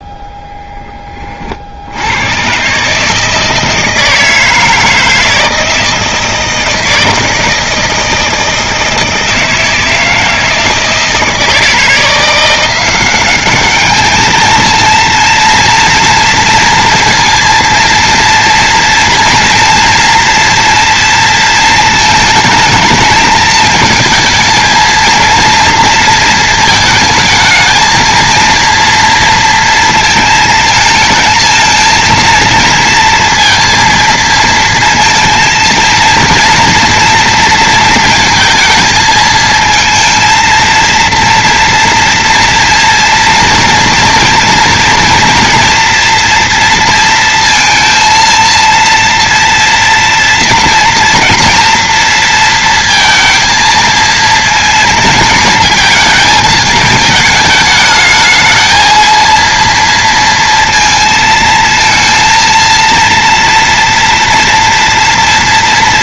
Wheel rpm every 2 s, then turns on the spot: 20, 130, 160, 160, 160, 160, 180, 230, 230, 230, 230, 220, 230, 220, 230, 220, 230, 230, 230, 220, 230, 230, 230, 230, 230, 230, 230, 230, 220, 220, 230, 230, 230.
none